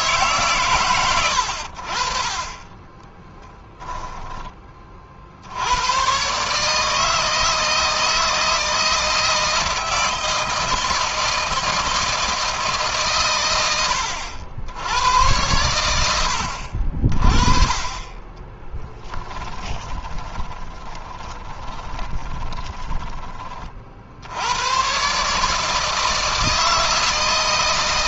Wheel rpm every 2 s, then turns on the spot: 110, 20, 20, 150, 160, 160, 140, 90, 50, 10, 10, 20, 120, 160.
2-4 18-22